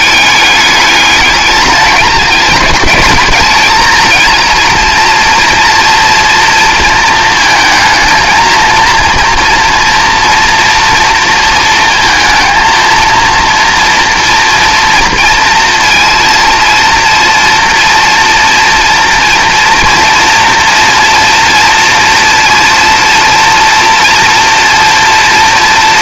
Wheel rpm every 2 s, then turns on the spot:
210, 210, 230, 230, 230, 230, 230, 230, 230, 230, 230, 230, 230.
none